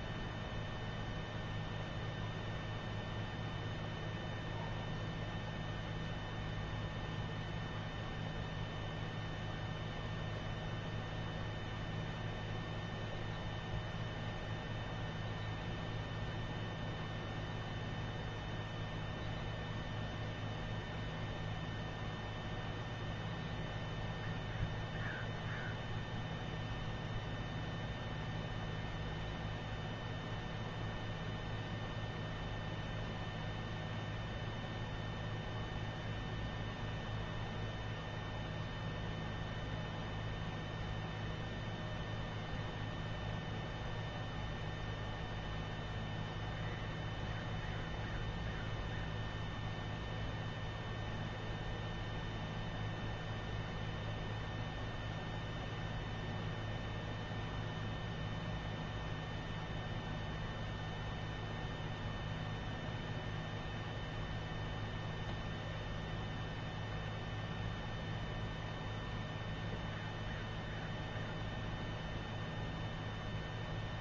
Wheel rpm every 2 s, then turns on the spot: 0, 0, 0, 0, 0, 0, 0, 0, 0, 0, 0, 0, 0, 0, 0, 0, 0, 0, 0, 0, 0, 0, 0, 0, 0, 0, 0, 0, 0, 0, 0, 0, 0, 0, 0, 0, 0.
none